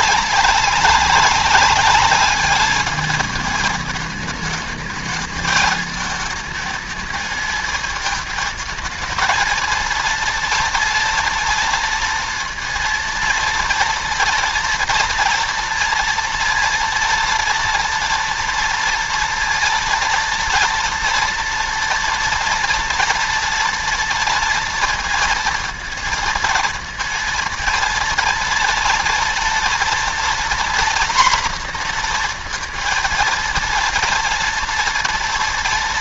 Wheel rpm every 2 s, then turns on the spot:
190, 210, 210, 220, 220, 230, 230, 230, 230, 230, 230, 230, 230, 230, 230, 240, 240, 230.
none